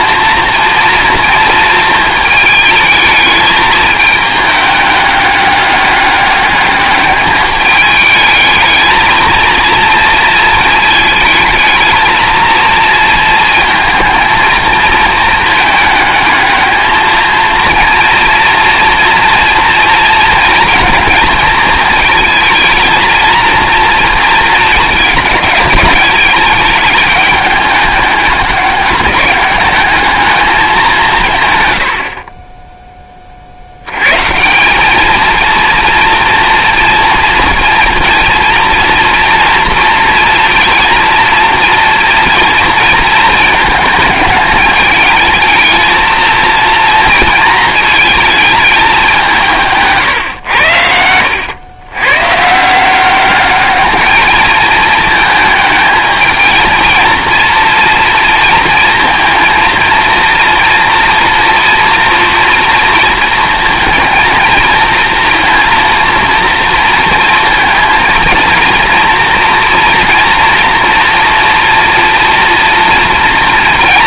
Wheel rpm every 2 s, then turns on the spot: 230, 210, 210, 200, 220, 220, 230, 220, 220, 230, 230, 230, 220, 210, 200, 210, 20, 180, 230, 230, 230, 220, 210, 230, 210, 100, 160, 220, 230, 230, 230, 230, 230, 230, 230, 230, 230.
none